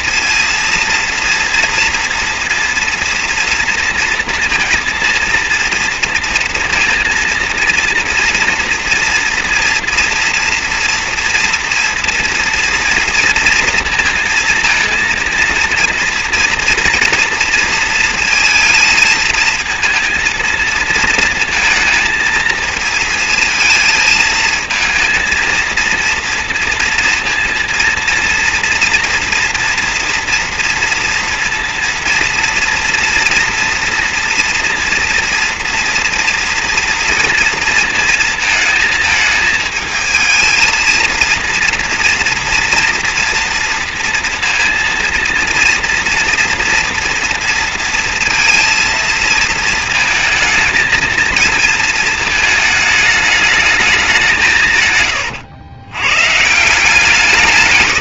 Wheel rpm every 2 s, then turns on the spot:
230, 240, 230, 230, 240, 230, 240, 230, 230, 220, 230, 230, 230, 230, 230, 230, 230, 240, 230, 220, 230, 230, 230, 230, 230, 220, 210, 120, 170.
54-56